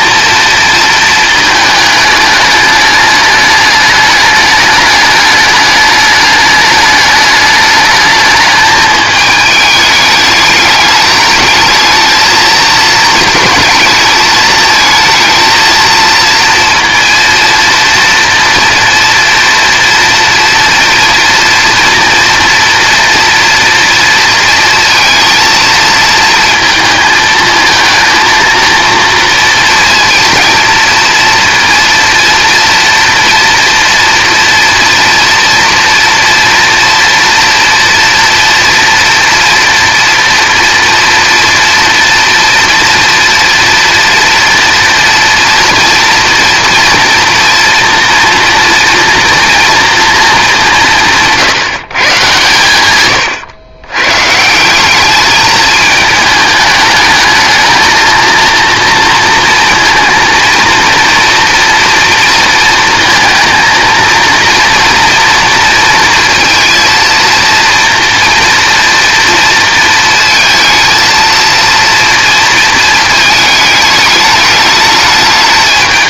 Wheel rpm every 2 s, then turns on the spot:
220, 210, 210, 210, 220, 210, 220, 220, 230, 240, 230, 240, 230, 220, 230, 230, 230, 240, 230, 230, 240, 230, 230, 230, 230, 170, 120, 190, 210, 230, 230, 230, 240, 230, 230, 230, 220, 210.
none